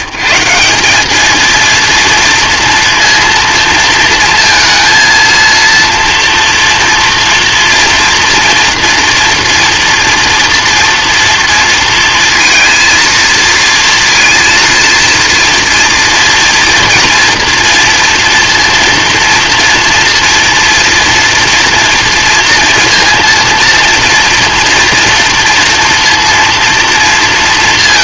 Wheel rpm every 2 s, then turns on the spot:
160, 230, 230, 230, 230, 230, 230, 230, 230, 230, 240, 230, 230, 230.
none